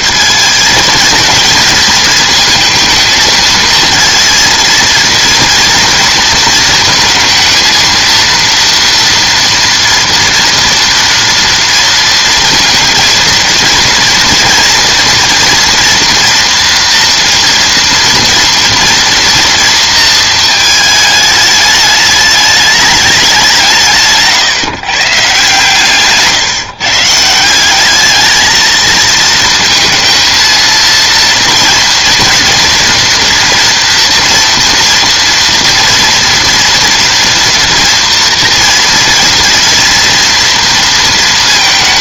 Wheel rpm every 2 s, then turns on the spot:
220, 230, 230, 220, 230, 230, 230, 230, 240, 230, 220, 210, 140, 150, 220, 230, 230, 230, 230, 230, 230.
none